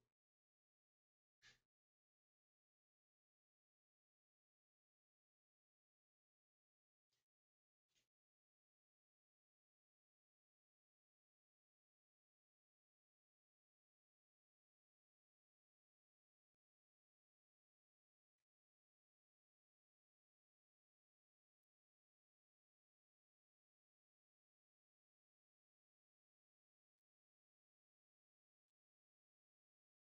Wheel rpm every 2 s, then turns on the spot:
0, 0, 0, 0, 0, 0, 0, 0, 0, 0, 0, 0, 0, 0, 0.
none